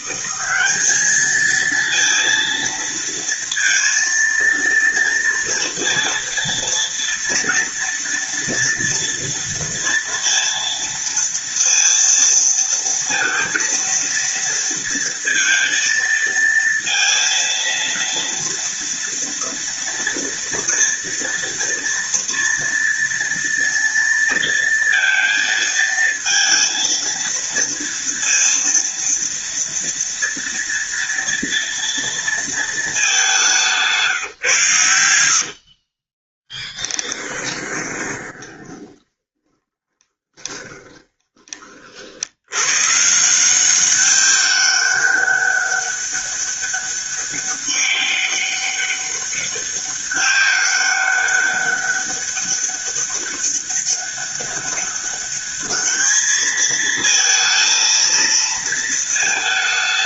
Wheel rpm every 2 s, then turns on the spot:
210, 230, 230, 230, 230, 230, 230, 230, 230, 230, 230, 230, 230, 230, 230, 230, 210, 100, 10, 20, 20, 130, 200, 200, 200, 200, 200, 200, 220, 220.
36-42